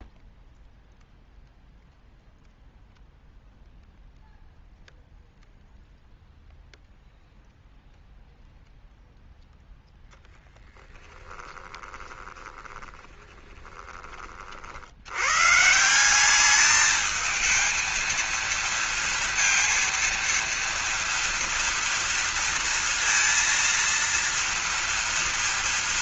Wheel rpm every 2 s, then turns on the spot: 0, 0, 0, 0, 0, 10, 20, 80, 210, 230, 230, 230, 230.
10-14